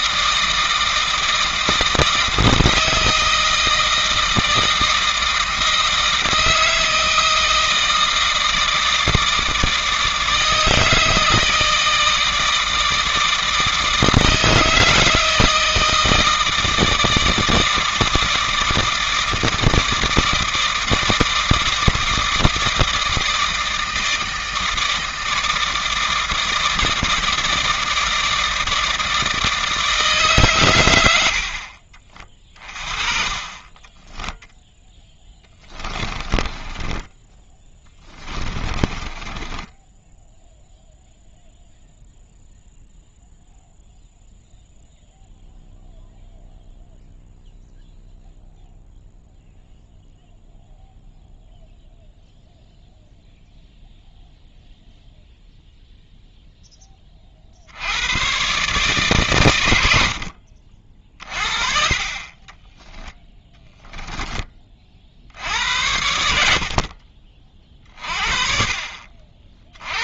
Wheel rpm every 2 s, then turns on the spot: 160, 160, 160, 160, 160, 160, 160, 160, 160, 160, 160, 160, 160, 160, 160, 120, 30, 0, 20, 20, 0, 0, 0, 0, 0, 0, 0, 0, 10, 140, 40, 10, 30, 60, 40.
36-40 62-64 66-68